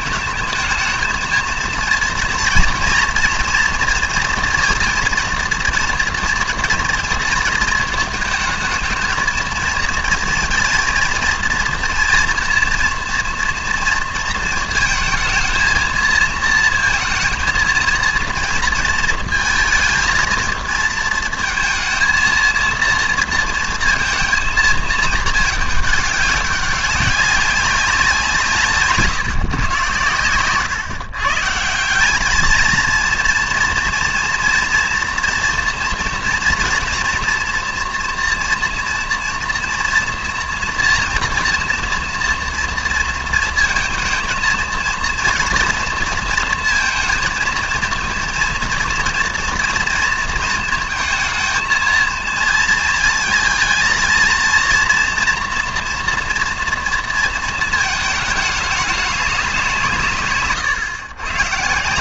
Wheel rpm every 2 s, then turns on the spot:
220, 240, 230, 230, 220, 230, 230, 220, 230, 230, 230, 230, 220, 200, 160, 120, 230, 240, 230, 230, 230, 230, 230, 220, 230, 220, 220, 230, 230, 210, 140.
28-30